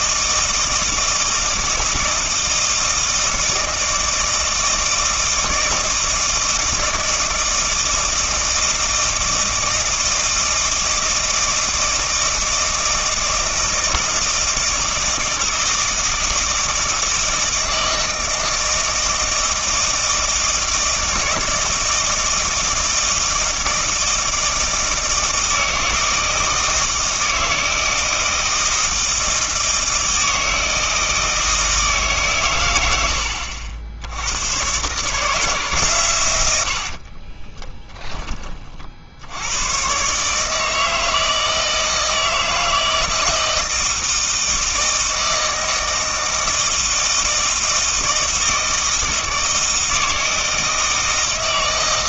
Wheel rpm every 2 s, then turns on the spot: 160, 160, 160, 160, 160, 160, 160, 160, 160, 160, 160, 160, 160, 160, 160, 160, 90, 130, 80, 40, 160, 160, 160, 160, 160, 160.
36-38